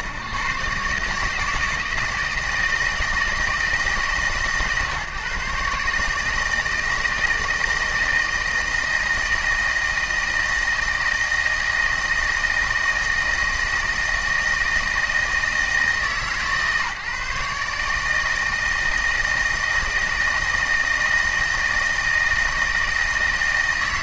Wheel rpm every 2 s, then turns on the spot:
110, 160, 140, 150, 160, 160, 160, 160, 150, 160, 160, 160.
none